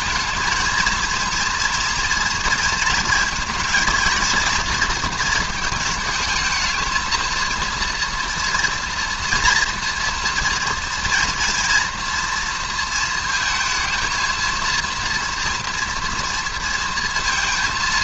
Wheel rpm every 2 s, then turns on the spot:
230, 230, 230, 220, 230, 230, 230, 230, 230.
none